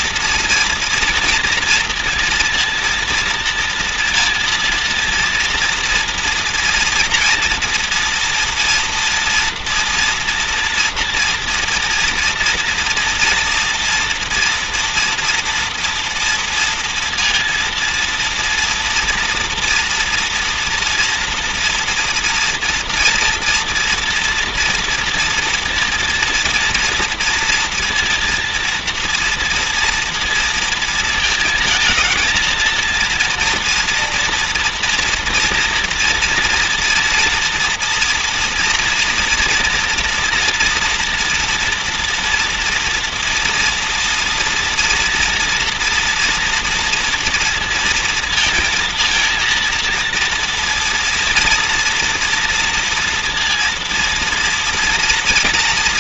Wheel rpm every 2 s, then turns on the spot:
230, 230, 230, 230, 230, 230, 240, 230, 230, 230, 240, 240, 230, 230, 230, 230, 230, 230, 230, 240, 240, 240, 230, 240, 230, 230, 230, 230.
none